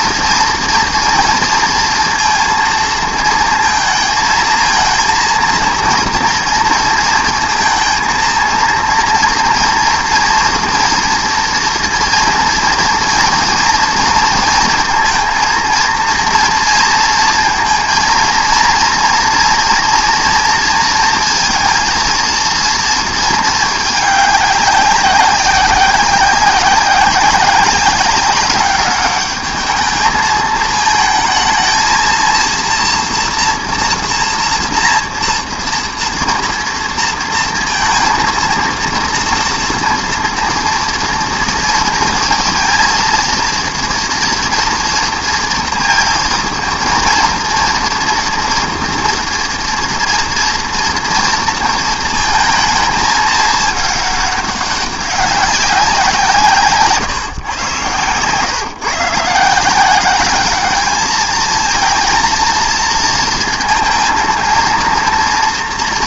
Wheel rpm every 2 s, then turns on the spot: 230, 230, 220, 230, 230, 230, 230, 230, 230, 230, 230, 230, 200, 180, 200, 220, 230, 240, 230, 230, 230, 230, 230, 230, 230, 230, 220, 200, 150, 150, 210, 230, 230.
none